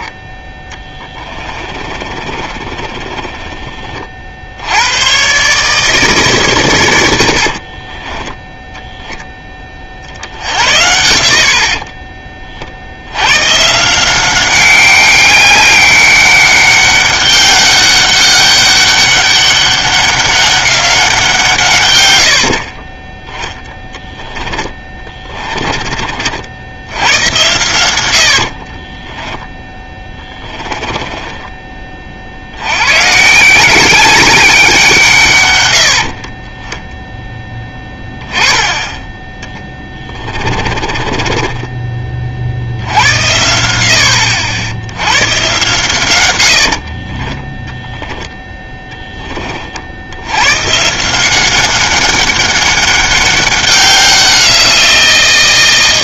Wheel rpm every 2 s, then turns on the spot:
10, 20, 80, 120, 0, 80, 40, 190, 200, 200, 200, 40, 10, 70, 50, 20, 90, 190, 20, 10, 30, 70, 90, 70, 10, 130, 200, 180.
2-4 22-26 28-32 40-42 46-48